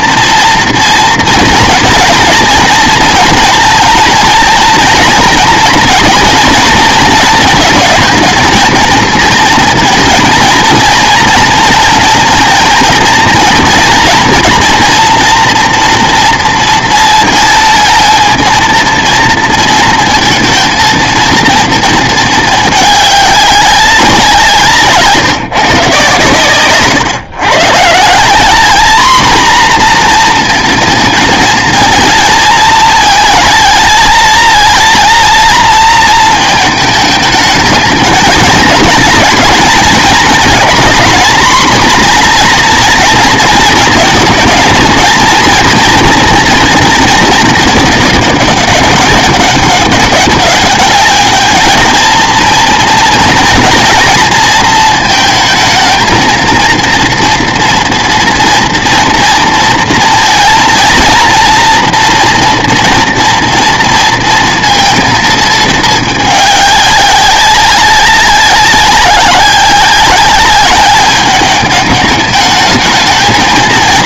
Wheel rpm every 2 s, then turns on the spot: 230, 230, 230, 220, 230, 230, 230, 230, 230, 230, 220, 210, 160, 130, 210, 230, 220, 230, 220, 220, 240, 230, 220, 240, 200, 200, 230, 220, 230, 240, 230, 230, 230, 200, 190, 200, 210.
none